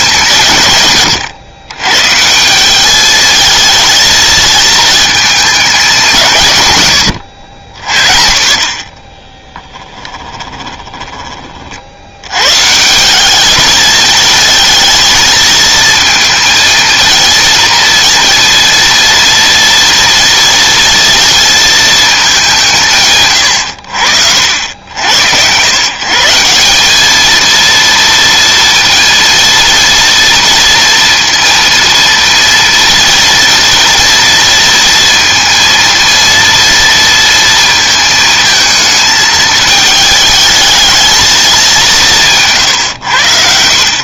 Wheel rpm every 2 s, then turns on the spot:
120, 210, 220, 100, 20, 20, 170, 220, 230, 230, 230, 160, 80, 210, 230, 230, 230, 230, 230, 220, 220, 110.
8-12